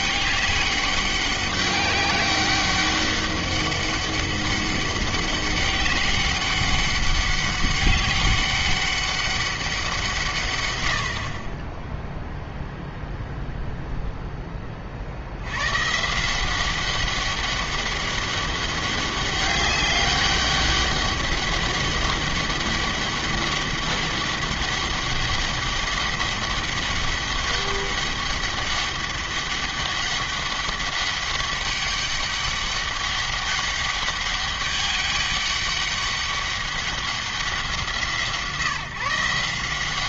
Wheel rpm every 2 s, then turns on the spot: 200, 200, 200, 200, 200, 100, 0, 40, 190, 200, 200, 200, 200, 200, 200, 200, 200, 200, 200, 160.
none